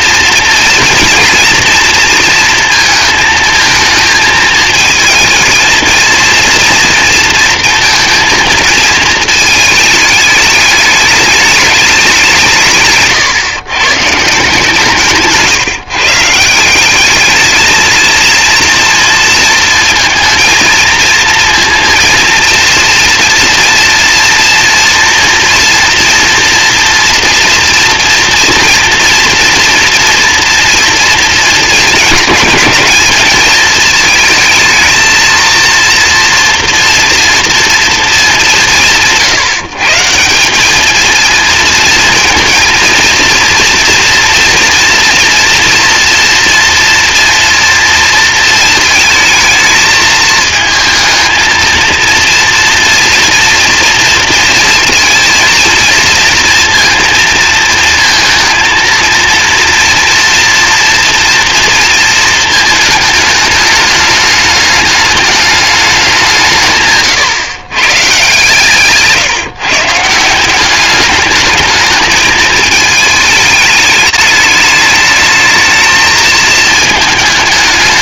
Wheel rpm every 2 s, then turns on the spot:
240, 230, 220, 230, 230, 210, 150, 160, 180, 230, 220, 230, 230, 230, 240, 230, 220, 220, 230, 180, 210, 230, 240, 230, 230, 220, 230, 230, 230, 230, 240, 220, 210, 150, 150, 190, 220, 210, 220.
68-70